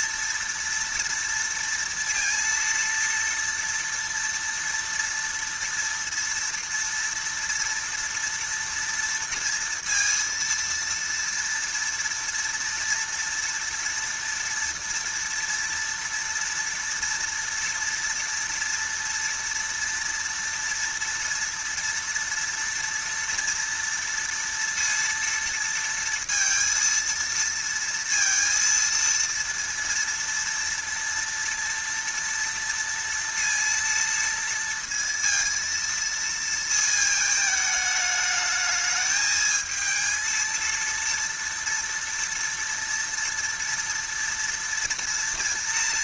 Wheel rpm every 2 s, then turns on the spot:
230, 230, 230, 230, 230, 230, 230, 230, 240, 240, 230, 230, 230, 230, 230, 230, 230, 230, 230, 220, 230, 230, 230.
none